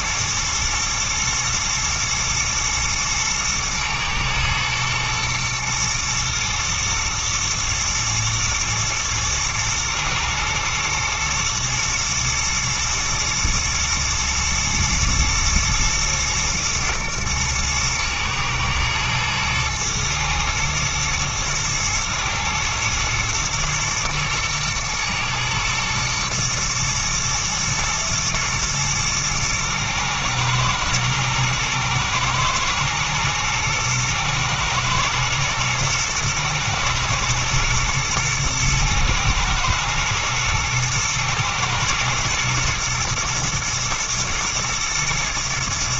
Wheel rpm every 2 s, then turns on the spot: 110, 120, 110, 120, 110, 120, 120, 120, 120, 120, 110, 110, 120, 120, 120, 110, 110, 110, 110, 120, 120, 120, 120.
none